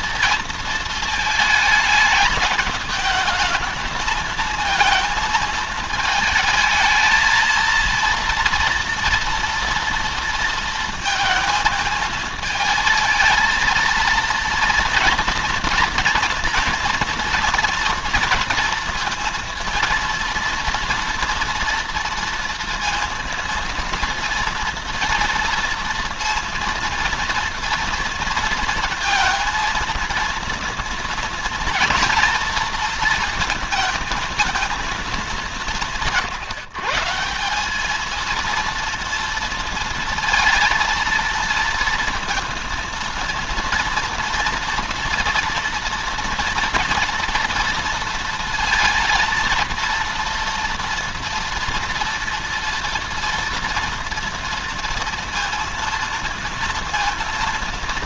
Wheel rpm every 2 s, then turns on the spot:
230, 220, 220, 220, 240, 230, 220, 230, 230, 230, 230, 230, 230, 230, 230, 230, 230, 220, 160, 230, 230, 230, 230, 230, 230, 230, 230, 230, 230.
none